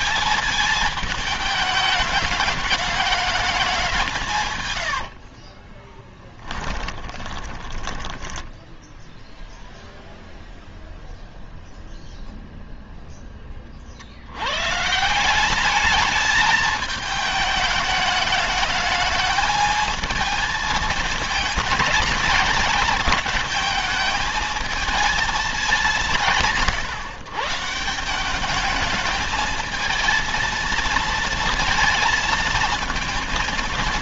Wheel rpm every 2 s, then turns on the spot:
210, 210, 110, 10, 0, 0, 0, 110, 210, 210, 220, 220, 220, 140, 210, 230, 230.
4-8